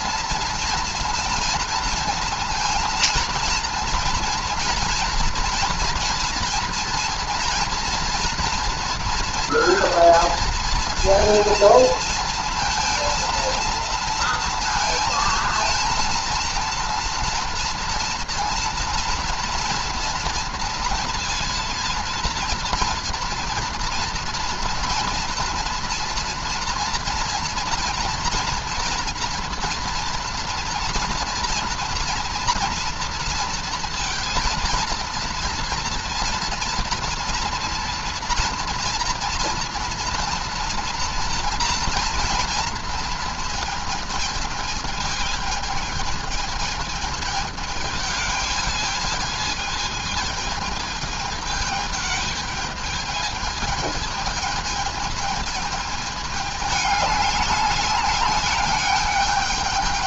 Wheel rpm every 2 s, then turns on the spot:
230, 230, 230, 230, 240, 230, 230, 230, 230, 240, 230, 230, 230, 240, 240, 230, 230, 230, 230, 230, 230, 230, 220, 220, 220, 220, 210, 220, 210, 200.
none